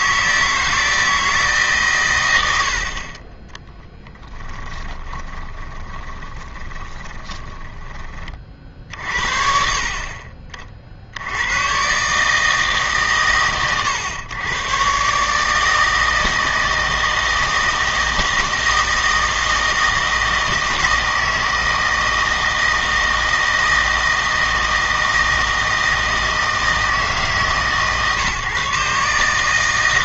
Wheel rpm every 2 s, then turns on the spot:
160, 70, 10, 20, 50, 50, 150, 110, 160, 160, 160, 160, 160, 160, 140.
4-8